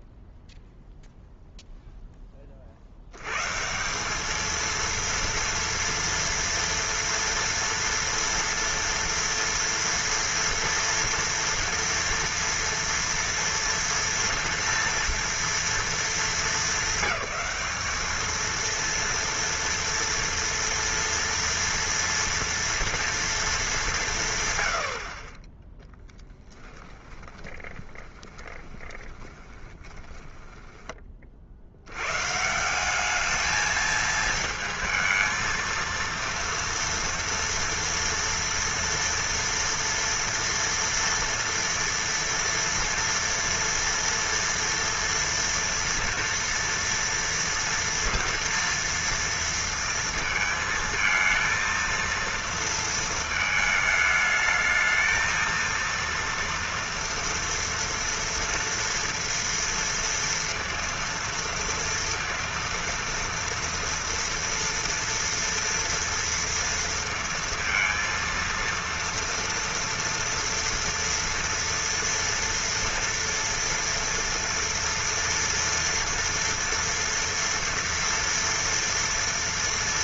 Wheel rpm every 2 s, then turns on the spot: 0, 40, 220, 230, 230, 230, 240, 230, 200, 230, 230, 230, 100, 10, 20, 10, 170, 220, 240, 230, 230, 230, 230, 230, 230, 220, 230, 220, 230, 230, 230, 230, 230, 230, 230, 230, 230, 230, 230, 230.
26-32